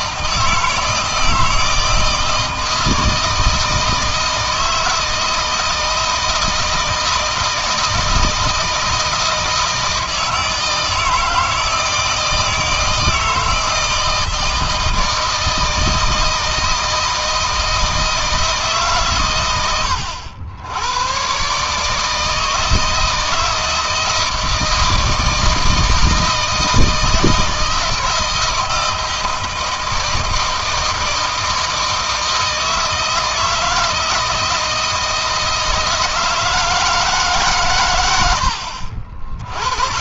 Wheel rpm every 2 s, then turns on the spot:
160, 160, 160, 160, 160, 160, 160, 160, 160, 140, 100, 160, 160, 160, 160, 160, 160, 160, 150, 40.
none